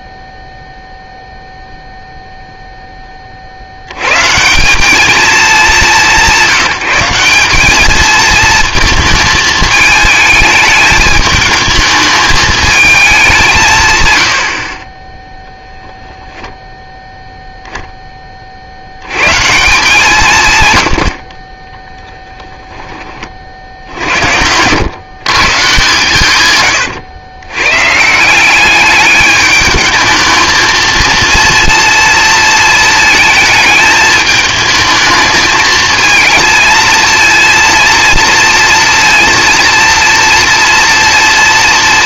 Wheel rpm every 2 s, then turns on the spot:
0, 0, 180, 180, 230, 220, 220, 50, 10, 70, 110, 10, 90, 120, 200, 220, 230, 220, 220, 230, 230.
none